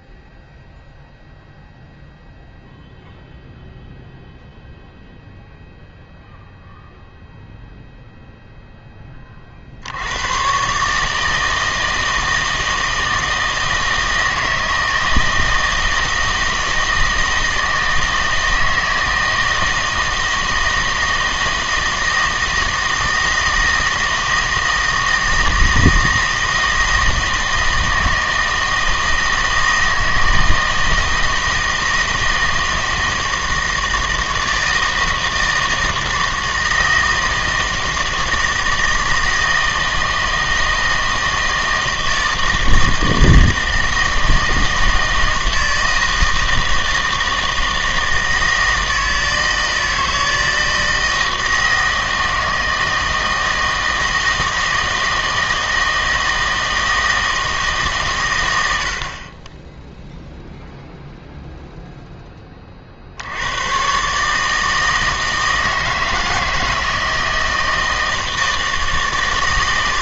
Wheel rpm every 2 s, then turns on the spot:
0, 0, 0, 0, 0, 130, 160, 160, 160, 160, 170, 160, 160, 160, 160, 160, 160, 160, 160, 160, 160, 160, 160, 160, 160, 160, 160, 160, 160, 90, 0, 20, 150, 160, 160.
none